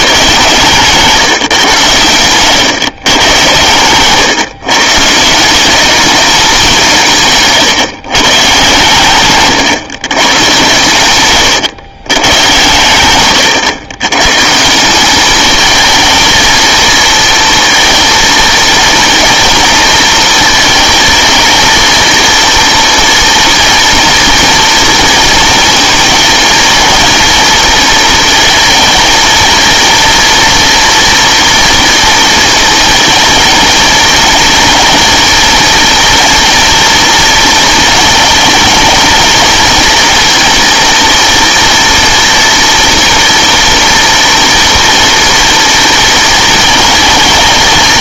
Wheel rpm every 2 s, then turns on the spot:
140, 120, 130, 190, 140, 120, 120, 160, 220, 230, 230, 230, 230, 220, 230, 230, 220, 230, 230, 230, 230, 230, 240, 220.
none